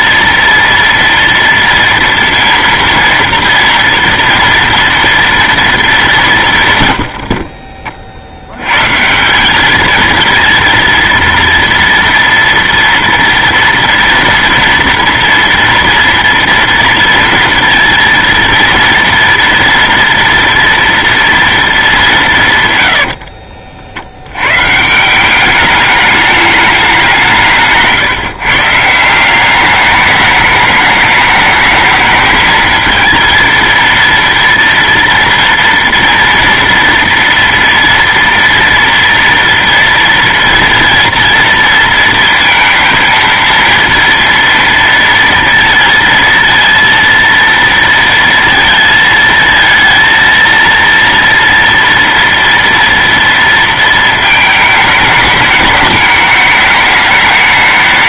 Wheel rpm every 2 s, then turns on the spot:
230, 230, 240, 150, 90, 230, 240, 230, 230, 230, 240, 140, 130, 210, 140, 210, 220, 230, 230, 230, 230, 220, 230, 230, 230, 230, 230, 220, 210.
none